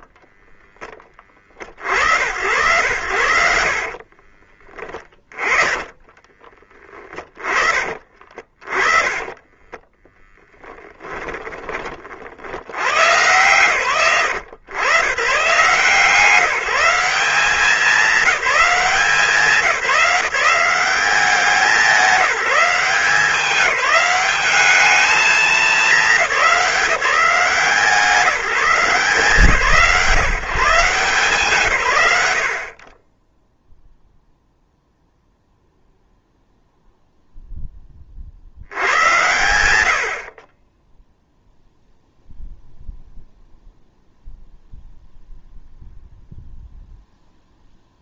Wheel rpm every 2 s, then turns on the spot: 30, 90, 30, 20, 40, 30, 50, 110, 160, 200, 170, 190, 200, 200, 180, 150, 90, 0, 0, 70, 20, 0, 0, 0.
0-2 4-8 10-12